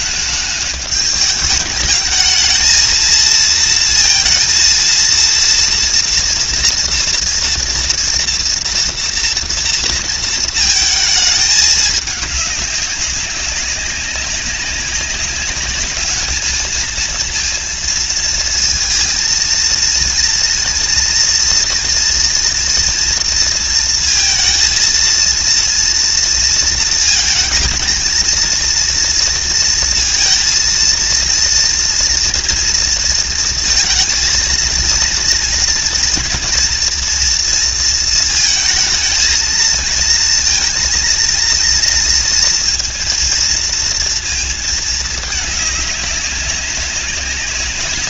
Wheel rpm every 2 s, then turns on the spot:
210, 230, 230, 230, 230, 220, 200, 190, 220, 230, 230, 230, 230, 220, 230, 230, 230, 230, 240, 220, 230, 230, 220, 190.
none